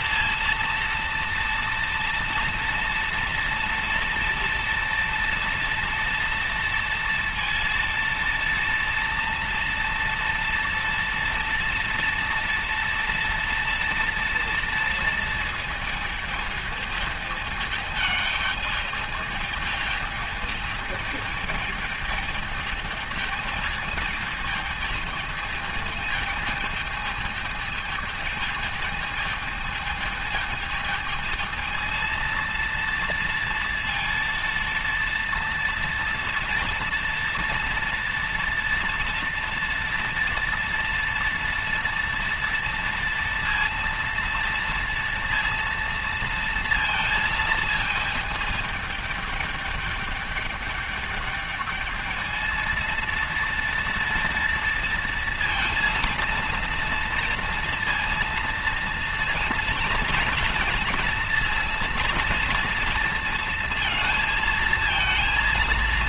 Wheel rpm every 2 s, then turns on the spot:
230, 230, 230, 230, 230, 230, 230, 230, 220, 210, 210, 220, 220, 220, 220, 220, 230, 230, 230, 230, 230, 230, 230, 230, 210, 210, 220, 230, 230, 230, 230, 230, 220.
none